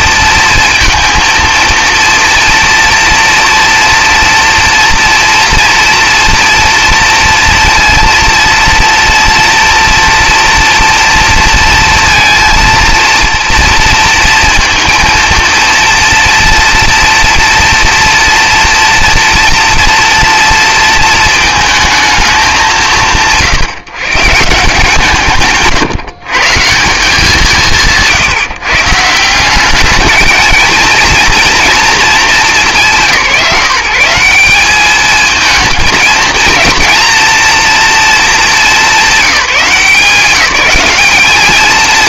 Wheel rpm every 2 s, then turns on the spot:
230, 240, 230, 230, 230, 230, 230, 230, 230, 230, 230, 170, 150, 150, 140, 220, 190, 190, 230, 210, 180.
none